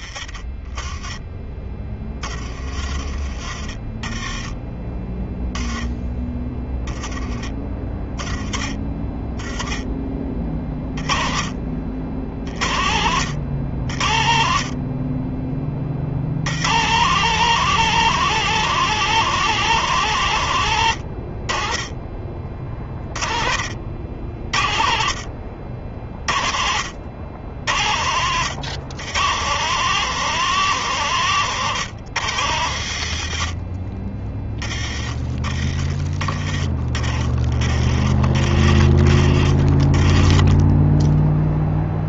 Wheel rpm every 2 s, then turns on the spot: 20, 30, 20, 10, 20, 20, 50, 70, 70, 170, 130, 40, 70, 50, 100, 150, 100, 20, 30, 40, 20.
none